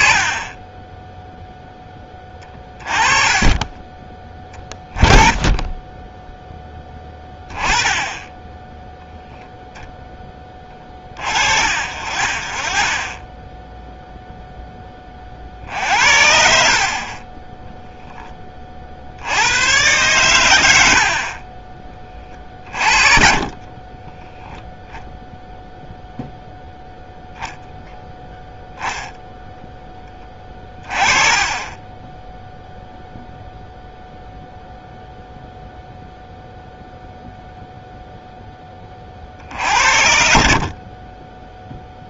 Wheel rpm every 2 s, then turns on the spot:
20, 20, 20, 10, 10, 30, 30, 0, 60, 30, 100, 40, 0, 0, 0, 20, 0, 0, 0, 20, 60.
2-4 22-24